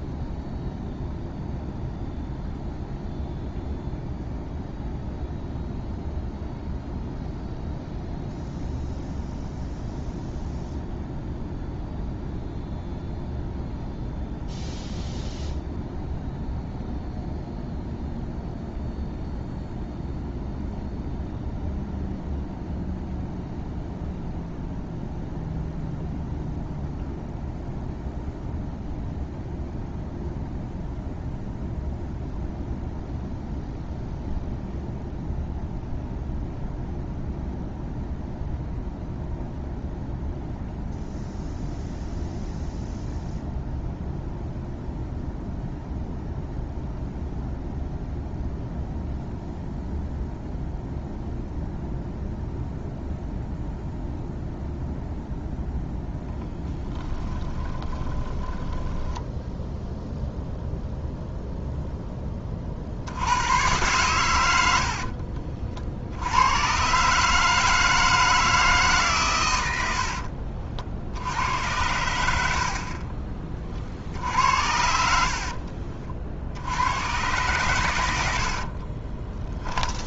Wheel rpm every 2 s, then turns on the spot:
0, 0, 0, 0, 0, 0, 0, 0, 0, 0, 0, 0, 0, 0, 0, 0, 0, 0, 0, 0, 0, 0, 0, 0, 0, 0, 0, 0, 10, 20, 0, 40, 80, 120, 150, 60, 50, 70, 80, 50.
56-60 64-66 72-76 78-80